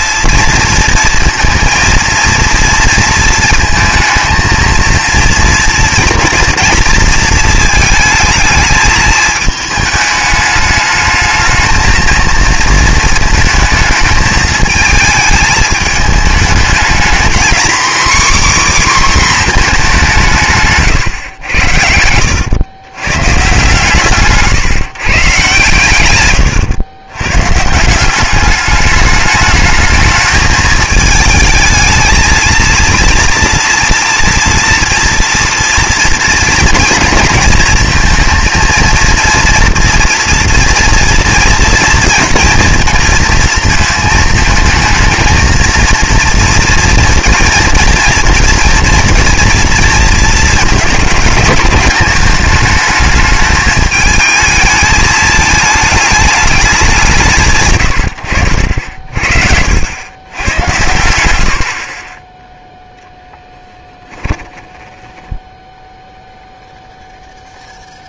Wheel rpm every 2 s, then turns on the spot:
230, 230, 230, 230, 220, 210, 230, 220, 220, 270, 140, 120, 150, 100, 200, 220, 230, 230, 230, 230, 230, 230, 220, 230, 230, 220, 210, 220, 200, 70, 100, 0, 10, 0.
64-66